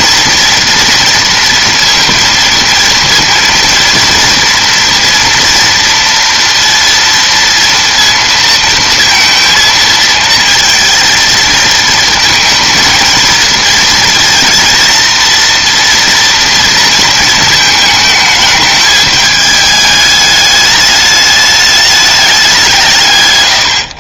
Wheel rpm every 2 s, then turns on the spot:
230, 230, 230, 230, 230, 220, 220, 230, 230, 220, 210, 180.
none